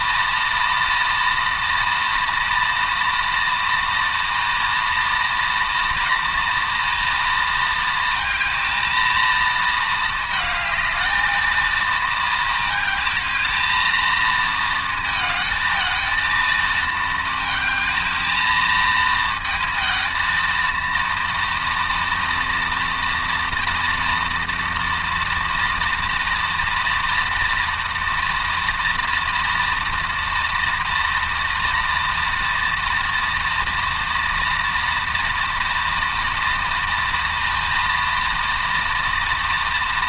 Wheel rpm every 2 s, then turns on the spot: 230, 240, 230, 230, 230, 220, 220, 220, 220, 220, 230, 230, 230, 230, 230, 240, 230, 230, 230, 230.
none